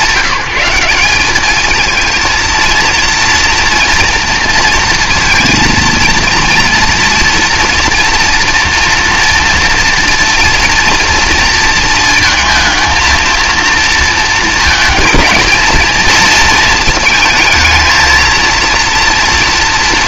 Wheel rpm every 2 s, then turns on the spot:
180, 230, 230, 230, 230, 240, 230, 230, 220, 230.
none